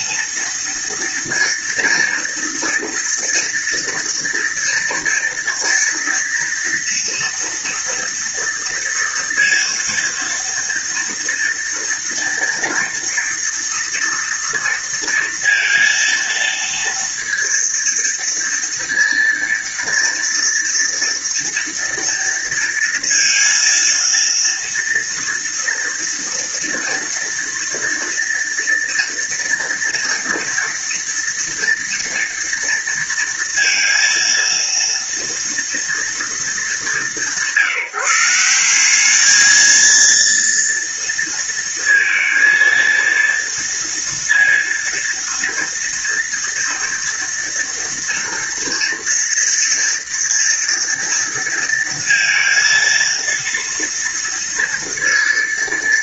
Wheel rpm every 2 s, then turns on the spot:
230, 230, 230, 230, 230, 230, 230, 230, 230, 230, 230, 230, 230, 240, 230, 230, 230, 230, 210, 170, 230, 230, 230, 230, 230, 230, 230, 230.
none